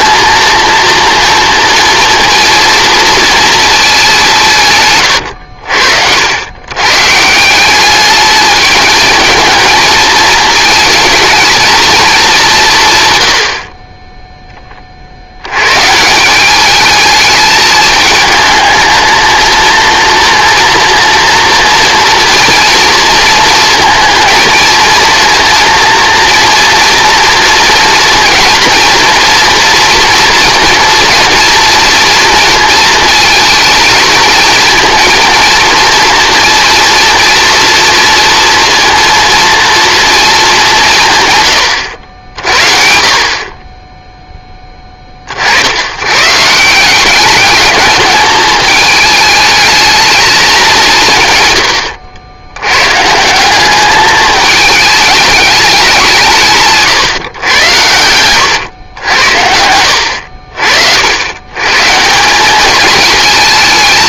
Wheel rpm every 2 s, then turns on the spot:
230, 240, 160, 110, 210, 220, 190, 10, 200, 220, 230, 240, 230, 230, 230, 240, 230, 230, 230, 230, 200, 70, 10, 160, 220, 200, 100, 210, 160, 110, 60, 200.
58-60